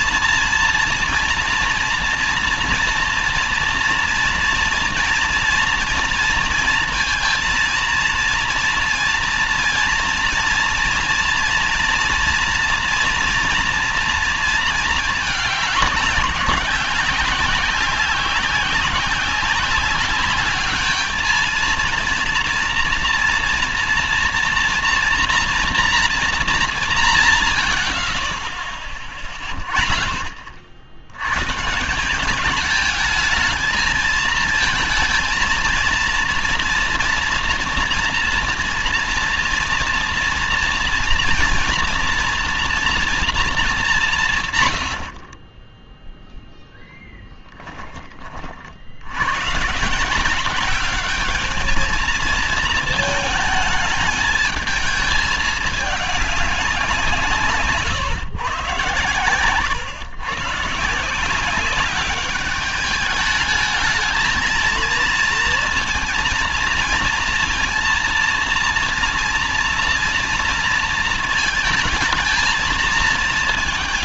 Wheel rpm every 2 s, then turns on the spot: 230, 230, 230, 230, 230, 230, 230, 230, 190, 190, 210, 230, 240, 220, 50, 60, 210, 220, 230, 230, 230, 230, 110, 0, 60, 200, 230, 210, 190, 120, 140, 210, 220, 230, 230, 230, 220.
none